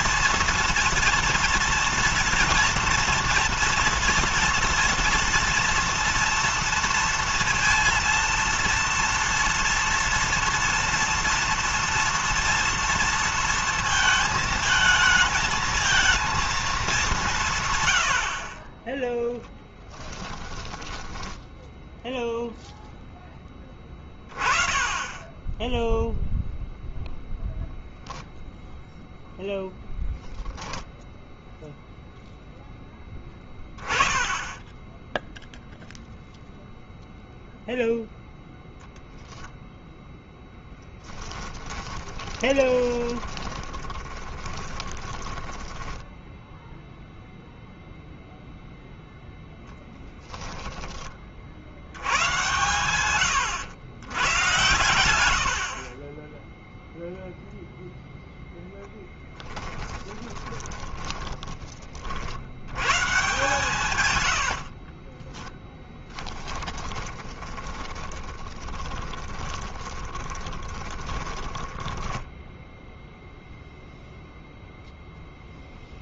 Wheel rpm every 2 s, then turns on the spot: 240, 230, 240, 230, 230, 230, 230, 220, 200, 10, 10, 0, 20, 0, 0, 0, 0, 10, 0, 0, 10, 20, 10, 0, 0, 20, 130, 120, 0, 0, 20, 100, 40, 20, 20, 20, 0, 0.
18-20 40-46 60-62 64-72